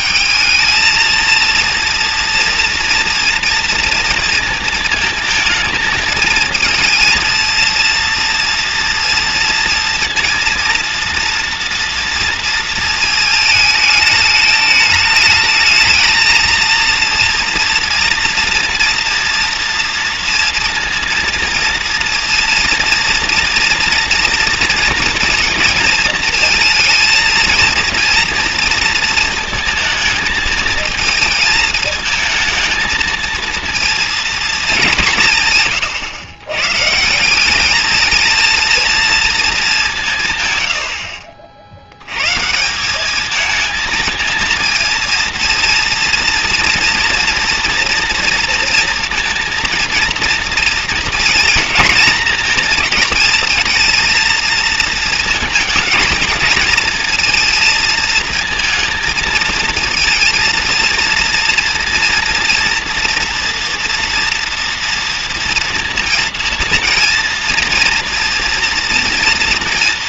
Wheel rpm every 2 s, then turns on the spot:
230, 230, 230, 220, 230, 230, 220, 220, 230, 230, 230, 230, 230, 230, 230, 220, 220, 190, 140, 230, 90, 160, 220, 230, 230, 230, 230, 230, 220, 230, 230, 230, 230, 230, 240.
none